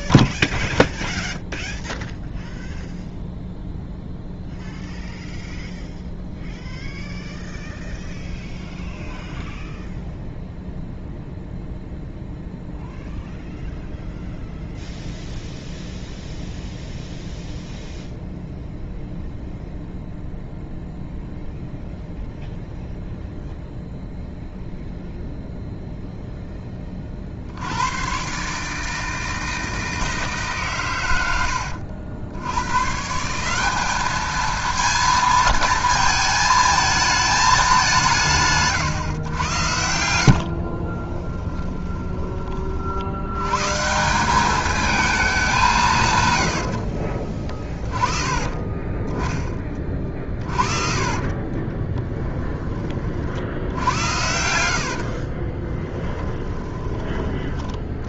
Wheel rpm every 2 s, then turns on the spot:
0, 0, 0, 0, 0, 0, 0, 0, 0, 0, 0, 0, 0, 20, 150, 130, 120, 220, 220, 150, 50, 50, 210, 80, 30, 50, 30, 70, 20.
40-42 46-52 54-58